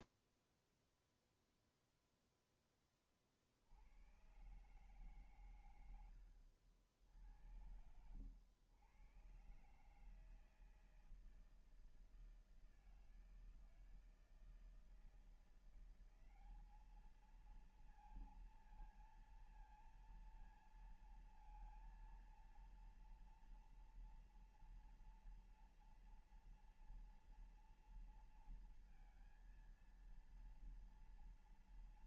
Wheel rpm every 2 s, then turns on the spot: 0, 10, 120, 90, 90, 150, 160, 160, 200, 230, 230, 230, 230, 230, 230, 230.
6-8